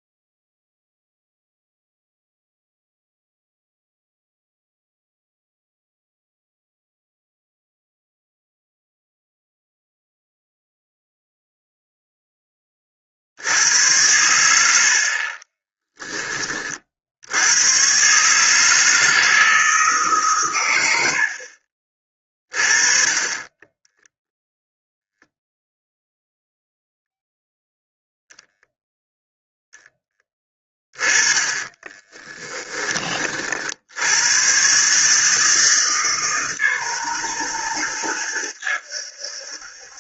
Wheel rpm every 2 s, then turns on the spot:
0, 0, 0, 0, 0, 0, 20, 80, 40, 150, 120, 30, 0, 0, 0, 10, 30, 110, 140, 100.
32-34